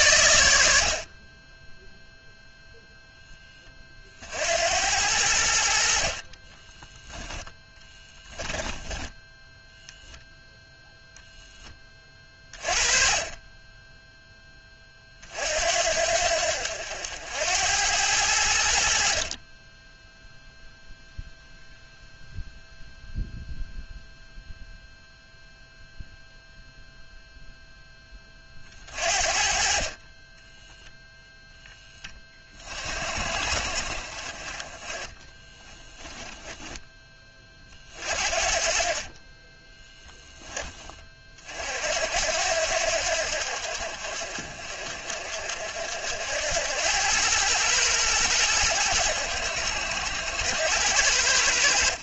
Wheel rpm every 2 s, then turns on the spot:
60, 0, 90, 20, 10, 0, 30, 30, 80, 60, 0, 0, 0, 0, 40, 0, 40, 20, 10, 40, 30, 80, 50, 90, 90, 80.
6-10